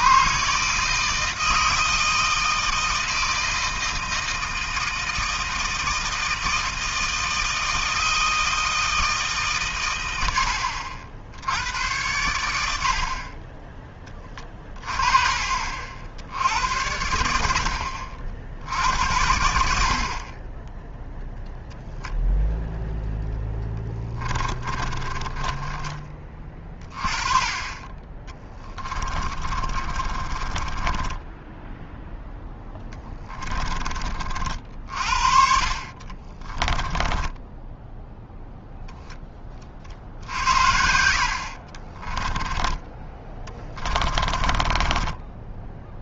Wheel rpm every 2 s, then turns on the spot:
150, 160, 160, 160, 160, 70, 80, 20, 90, 70, 10, 0, 20, 30, 20, 20, 10, 50, 10, 10, 70, 20, 30.
24-26 28-34 36-38 40-46